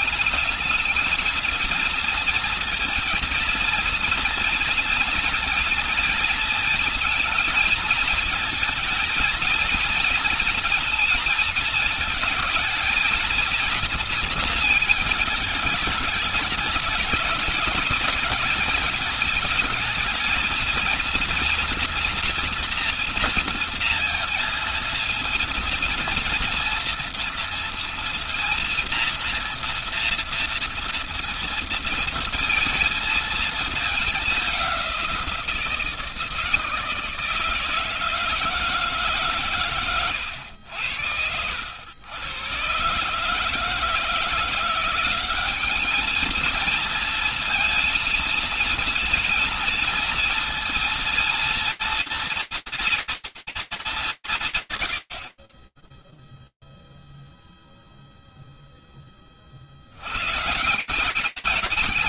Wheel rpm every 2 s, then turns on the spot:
220, 230, 230, 230, 230, 230, 230, 230, 200, 210, 230, 240, 230, 240, 230, 230, 230, 200, 160, 160, 100, 120, 160, 220, 230, 230, 230, 170, 0, 10, 170.
none